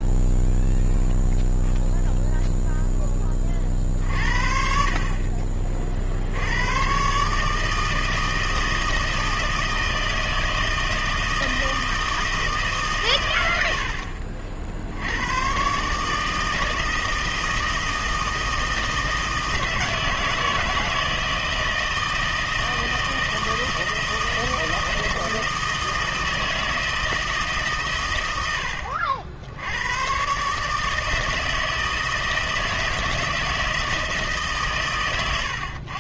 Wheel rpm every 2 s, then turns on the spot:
0, 10, 40, 110, 160, 160, 140, 70, 160, 160, 160, 160, 160, 160, 70, 150, 160, 130.
none